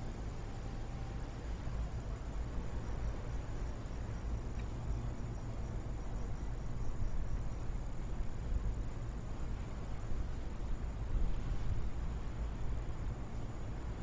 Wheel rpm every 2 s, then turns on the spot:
0, 0, 0, 0, 0, 0, 0.
none